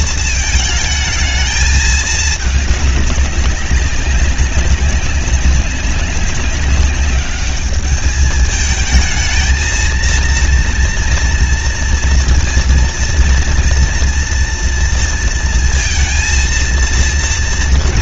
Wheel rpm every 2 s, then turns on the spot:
220, 210, 190, 200, 220, 230, 230, 230, 230.
none